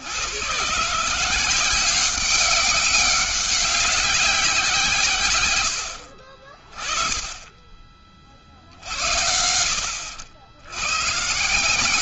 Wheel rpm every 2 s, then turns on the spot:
140, 190, 160, 30, 60, 110.
none